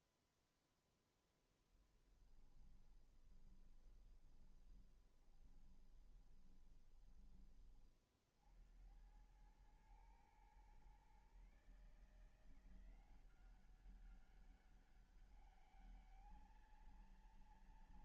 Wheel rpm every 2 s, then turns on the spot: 10, 30, 20, 20, 90, 130, 180, 200, 230.
2-6